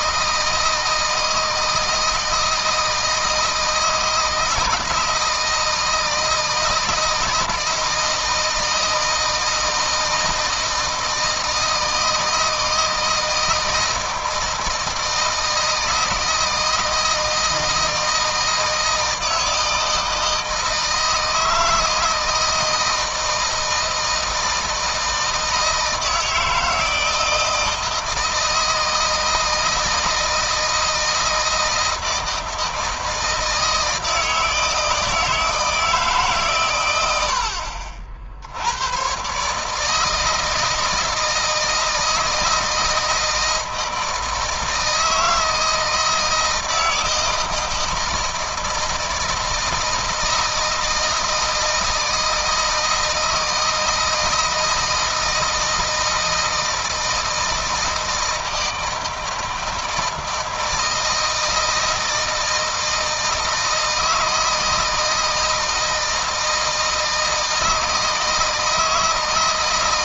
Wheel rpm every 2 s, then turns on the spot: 160, 160, 160, 160, 160, 160, 160, 160, 160, 160, 160, 160, 160, 160, 160, 160, 160, 160, 120, 110, 160, 160, 160, 170, 160, 160, 160, 160, 160, 160, 160, 160, 160, 160, 160.
none